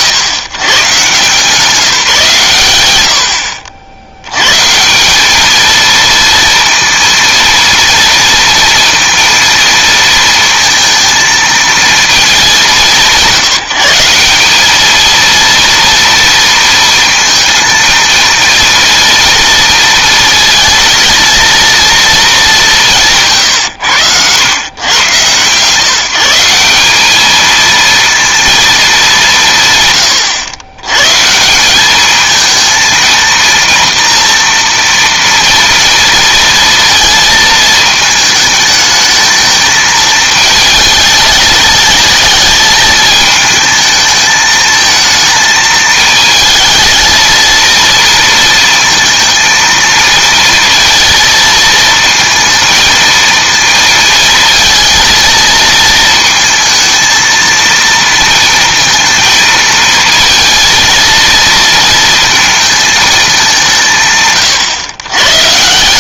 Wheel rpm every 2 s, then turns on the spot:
130, 120, 150, 230, 230, 230, 190, 210, 230, 230, 230, 200, 110, 180, 230, 120, 220, 230, 230, 220, 220, 220, 220, 220, 230, 230, 230, 220, 230, 230, 230, 230, 130.
none